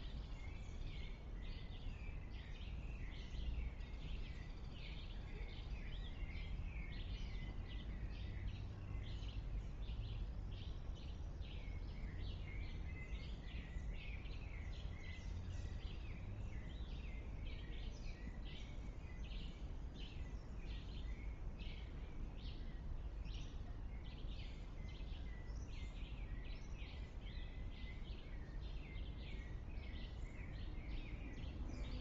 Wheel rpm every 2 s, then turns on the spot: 0, 0, 0, 0, 0, 0, 0, 0, 0, 0, 0, 0, 0, 0, 0, 0.
none